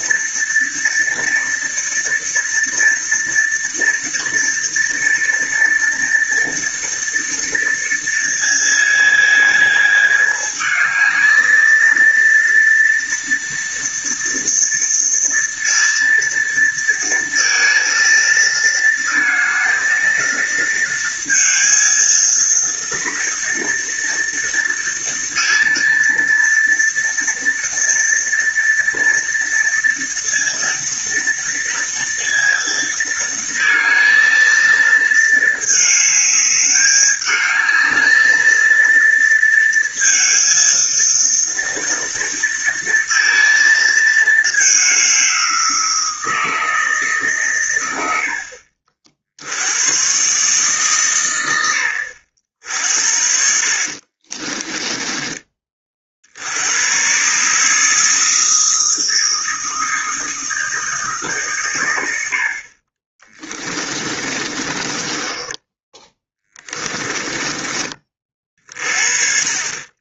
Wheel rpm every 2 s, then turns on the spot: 230, 240, 230, 230, 230, 220, 230, 230, 230, 230, 230, 230, 230, 230, 230, 230, 230, 220, 210, 230, 230, 230, 200, 160, 50, 130, 60, 20, 100, 160, 160, 40, 20, 20, 40.
54-56 64-68